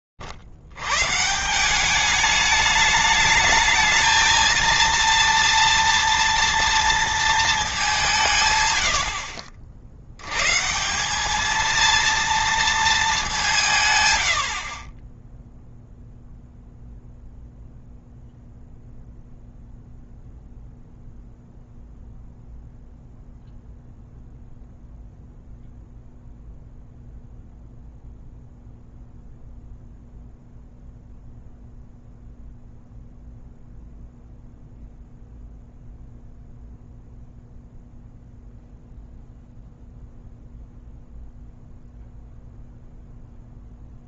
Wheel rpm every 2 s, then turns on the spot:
120, 210, 230, 230, 100, 180, 210, 30, 0, 0, 0, 0, 0, 0, 0, 0, 0, 0, 0, 0, 0, 0.
none